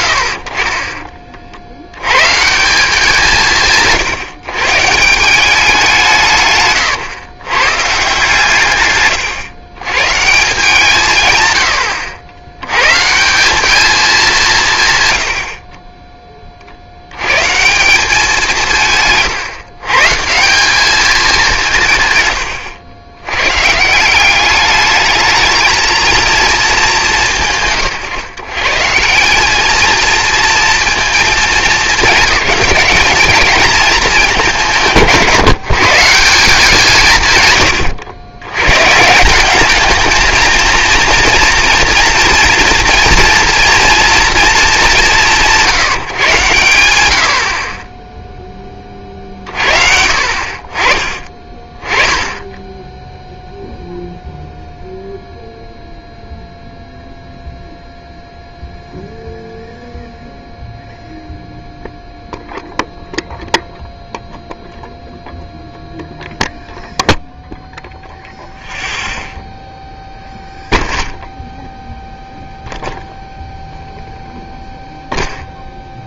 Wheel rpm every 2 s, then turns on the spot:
50, 160, 140, 130, 130, 160, 110, 170, 40, 160, 200, 90, 210, 220, 140, 230, 220, 170, 170, 120, 230, 230, 220, 110, 20, 40, 10, 0, 0, 0, 0, 0, 0, 0, 0, 0, 0, 0.
none